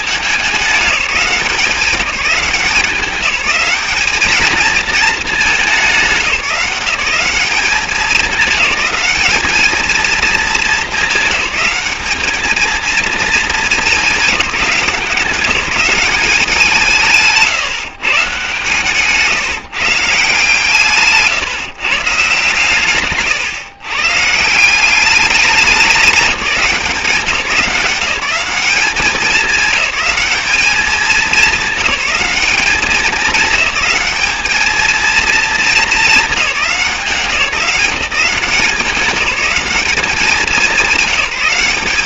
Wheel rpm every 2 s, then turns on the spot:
200, 180, 220, 180, 200, 220, 220, 190, 180, 150, 150, 140, 170, 190, 200, 210, 210, 210, 190, 190, 200.
none